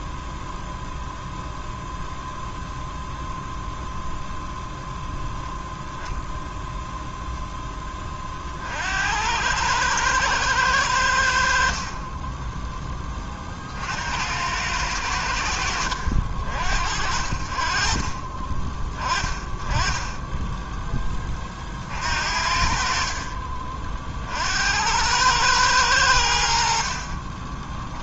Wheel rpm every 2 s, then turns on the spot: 0, 0, 0, 0, 50, 110, 20, 80, 60, 30, 10, 50, 70, 70.
20-22